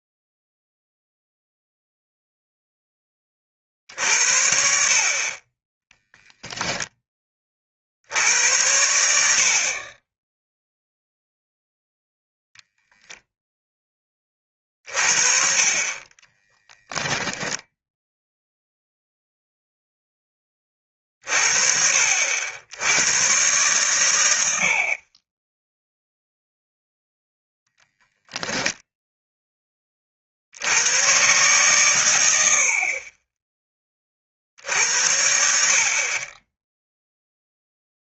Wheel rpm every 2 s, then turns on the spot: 0, 10, 50, 10, 90, 0, 0, 40, 10, 0, 30, 90, 50, 0, 0, 100, 40, 70, 10.
16-18